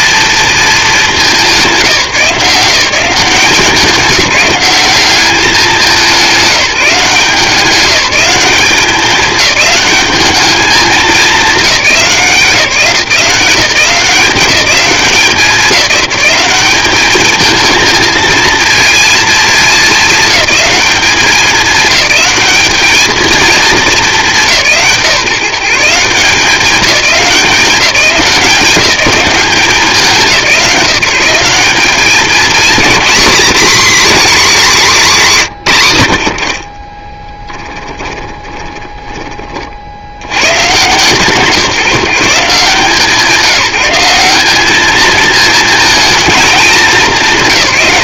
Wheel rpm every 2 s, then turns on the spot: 210, 180, 200, 180, 200, 210, 170, 190, 200, 230, 210, 220, 160, 190, 190, 180, 220, 220, 30, 20, 140, 170, 210, 210.
36-40